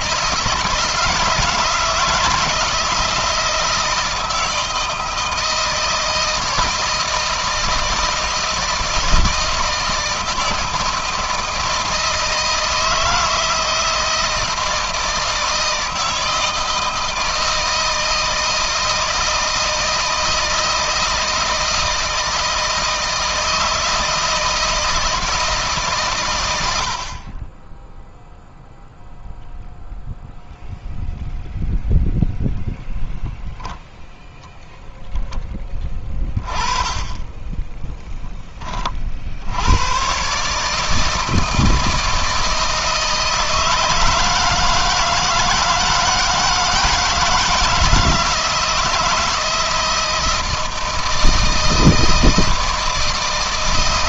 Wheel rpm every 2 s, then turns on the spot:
160, 160, 160, 160, 160, 160, 160, 160, 160, 160, 160, 160, 160, 100, 0, 0, 0, 0, 30, 20, 140, 160, 160, 160, 160, 160, 160.
none